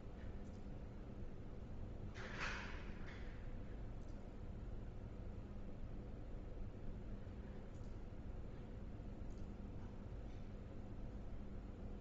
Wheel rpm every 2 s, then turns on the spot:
0, 0, 0, 0, 0, 0.
none